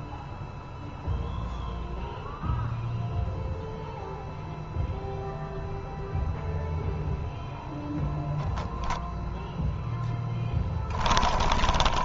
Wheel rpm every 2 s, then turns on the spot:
0, 0, 0, 0, 0, 20.
10-12